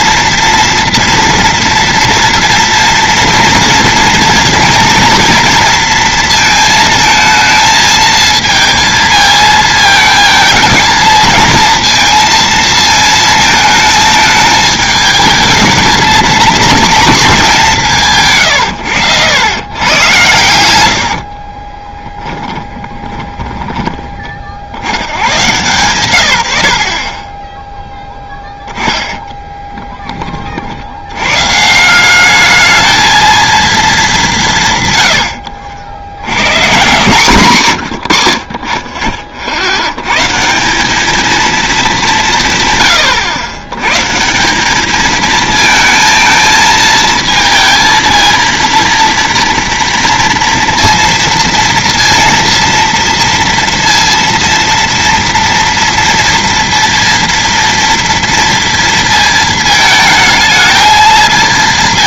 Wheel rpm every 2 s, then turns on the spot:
230, 230, 230, 220, 230, 220, 230, 210, 220, 110, 100, 20, 90, 60, 10, 70, 220, 140, 150, 30, 190, 130, 200, 220, 230, 230, 230, 230, 230, 230, 220.
22-24 28-30